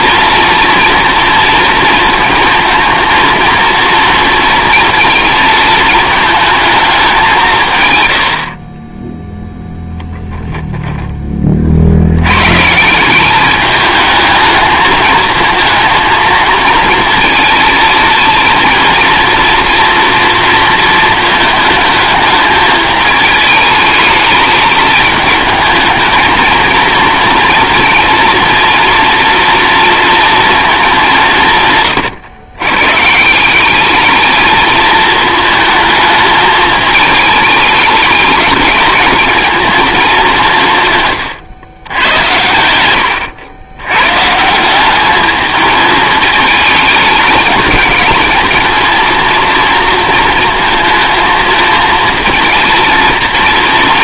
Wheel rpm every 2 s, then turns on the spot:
240, 230, 230, 210, 30, 0, 160, 220, 230, 230, 230, 220, 210, 230, 230, 220, 130, 220, 210, 210, 160, 100, 190, 220, 230, 230, 230.
8-10